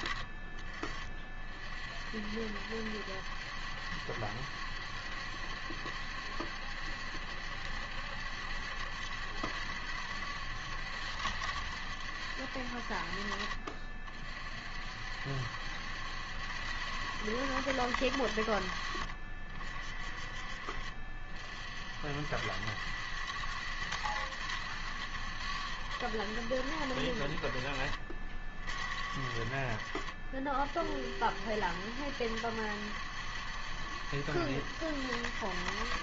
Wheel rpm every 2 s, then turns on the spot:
30, 70, 70, 70, 70, 70, 60, 60, 80, 60, 50, 80, 80, 60, 60, 50, 70, 80.
none